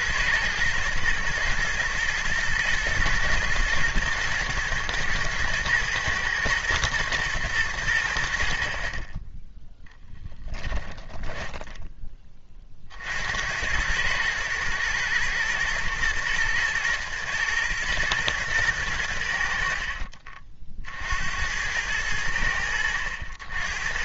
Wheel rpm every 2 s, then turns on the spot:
110, 110, 110, 110, 40, 10, 50, 110, 110, 100, 50, 70.
10-12